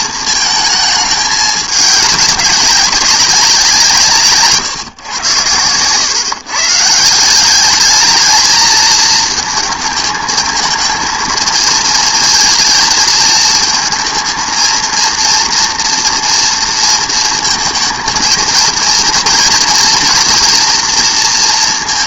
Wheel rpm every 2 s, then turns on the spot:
220, 190, 150, 140, 220, 220, 220, 230, 230, 220, 230.
none